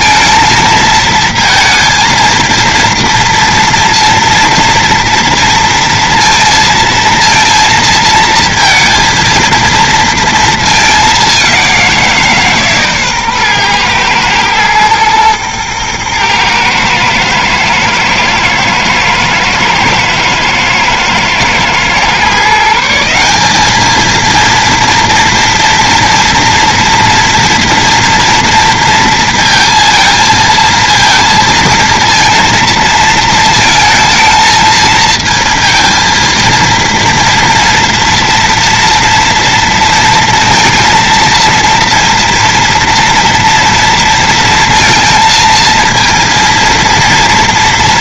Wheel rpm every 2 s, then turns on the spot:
220, 230, 230, 230, 230, 210, 140, 110, 110, 110, 110, 160, 230, 230, 230, 230, 230, 220, 230, 230, 230, 230, 230, 230.
none